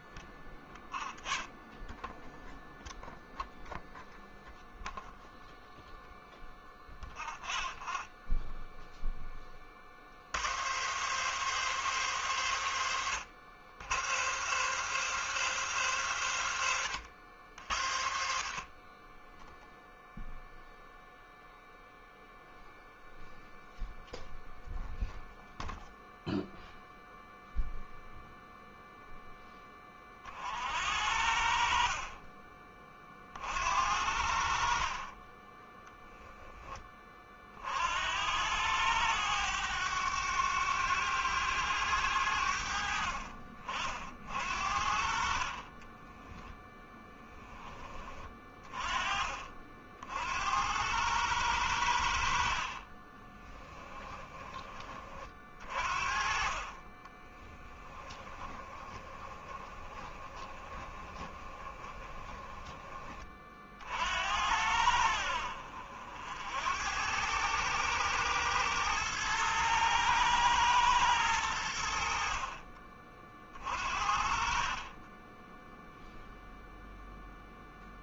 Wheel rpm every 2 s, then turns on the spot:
0, 0, 0, 0, 0, 120, 110, 150, 100, 30, 0, 0, 0, 0, 0, 60, 40, 50, 30, 100, 100, 60, 50, 10, 30, 100, 40, 30, 20, 20, 20, 30, 70, 90, 110, 110, 40, 20, 0.
46-48 52-54 56-62